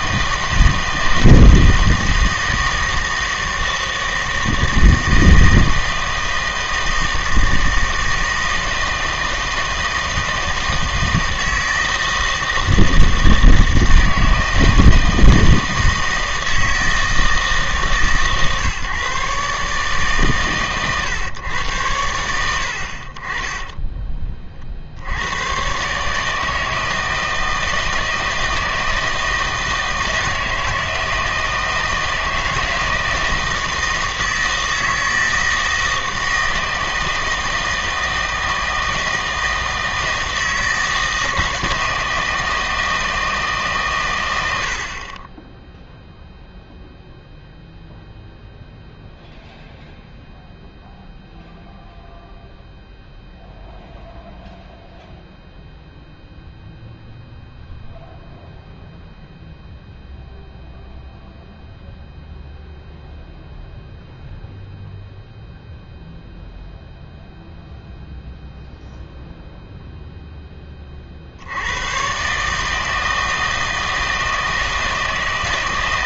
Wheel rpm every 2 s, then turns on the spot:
160, 160, 160, 160, 160, 160, 160, 160, 160, 140, 130, 70, 50, 160, 160, 160, 160, 160, 160, 160, 160, 160, 70, 0, 0, 0, 0, 0, 0, 0, 0, 0, 0, 0, 0, 20, 160, 160.
none